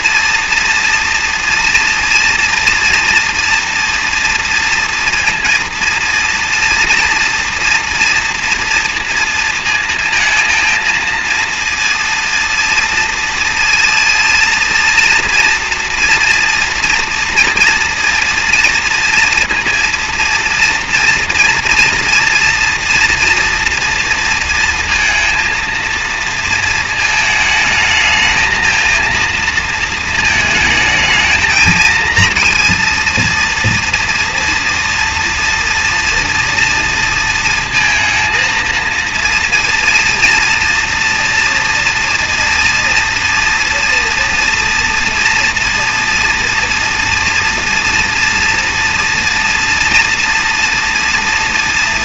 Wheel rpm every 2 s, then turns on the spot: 230, 230, 230, 230, 230, 230, 230, 230, 230, 230, 230, 230, 230, 230, 220, 220, 230, 230, 230, 230, 230, 230, 230, 240, 230, 240.
none